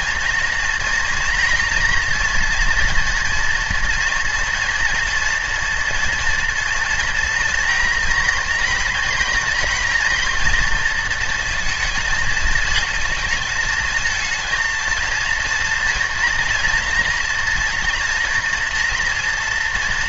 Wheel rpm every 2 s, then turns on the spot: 240, 230, 240, 240, 240, 230, 220, 230, 240, 240.
none